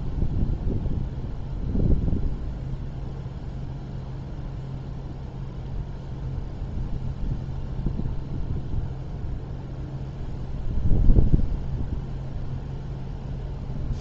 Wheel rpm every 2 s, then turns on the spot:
0, 0, 0, 0, 0, 0, 0.
none